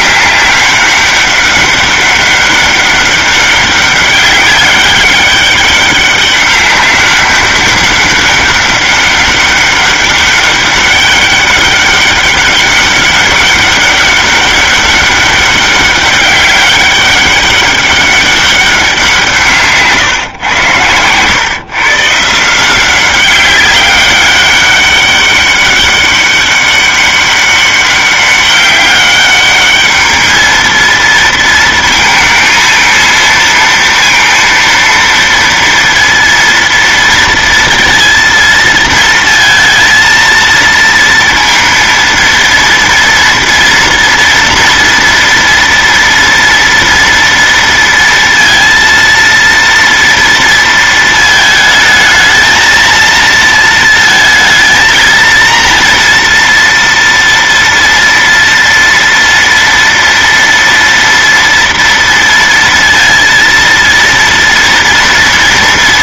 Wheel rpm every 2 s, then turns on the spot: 200, 200, 200, 200, 200, 200, 200, 200, 200, 190, 120, 180, 200, 200, 200, 230, 230, 230, 230, 230, 230, 230, 240, 230, 230, 230, 230, 230, 230, 230, 230, 230, 230.
20-22